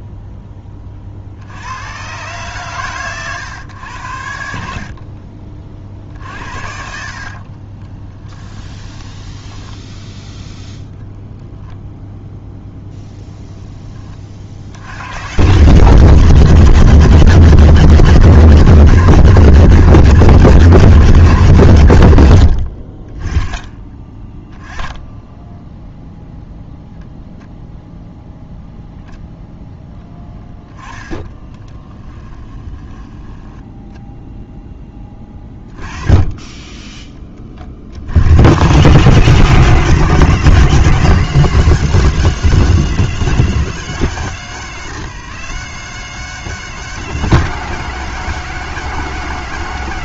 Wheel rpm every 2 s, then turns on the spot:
30, 130, 60, 60, 10, 0, 0, 70, 150, 150, 150, 50, 10, 0, 0, 10, 20, 10, 10, 100, 140, 120, 90, 100, 100.
4-10 32-34